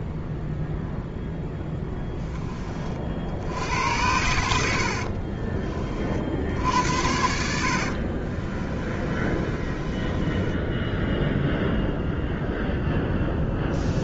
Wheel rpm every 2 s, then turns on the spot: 0, 20, 80, 60, 30, 10, 0.
8-12